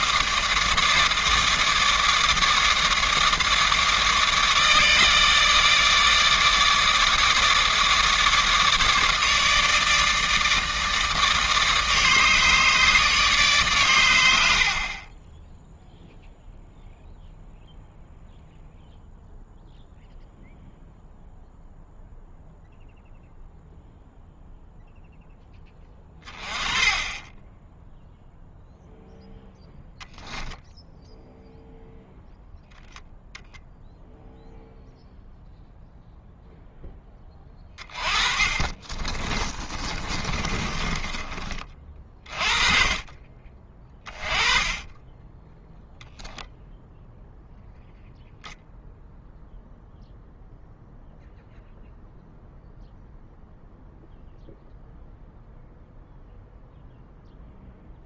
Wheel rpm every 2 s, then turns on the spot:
150, 150, 150, 150, 150, 150, 150, 40, 0, 0, 0, 0, 0, 20, 0, 0, 0, 0, 10, 20, 30, 30, 20, 0, 0, 0, 0, 0, 0.
14-16 38-42